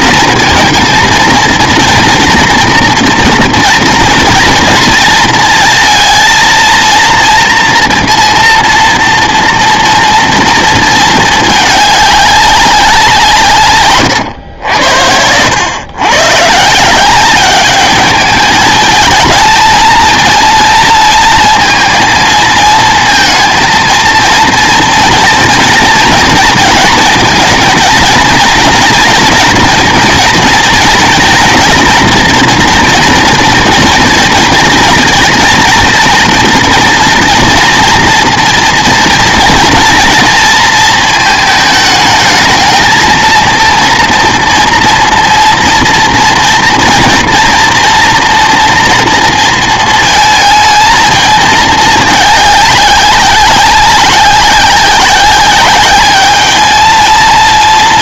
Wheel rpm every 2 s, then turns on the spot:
230, 230, 230, 230, 230, 220, 190, 90, 150, 210, 230, 220, 230, 230, 230, 240, 240, 230, 230, 230, 230, 220, 240, 230, 230, 220, 200, 190, 220.
14-16